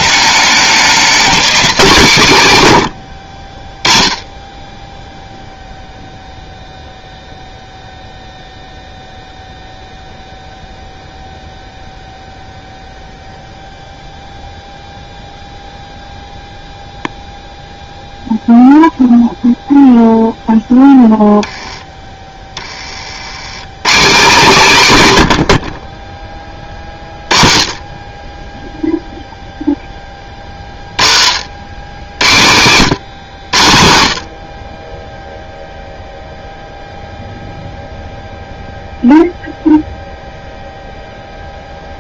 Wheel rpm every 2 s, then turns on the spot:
200, 110, 10, 0, 0, 0, 0, 0, 0, 0, 0, 30, 160, 30, 10, 30, 100, 30, 0, 0, 0.
none